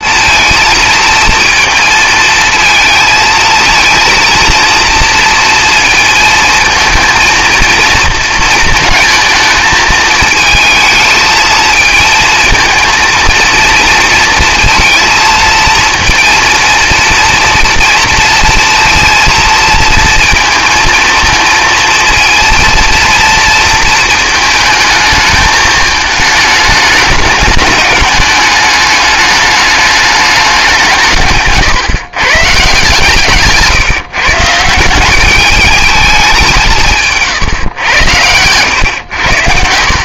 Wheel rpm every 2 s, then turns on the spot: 230, 230, 230, 230, 220, 220, 230, 230, 230, 230, 230, 230, 220, 220, 210, 190, 140, 170, 160, 110.
none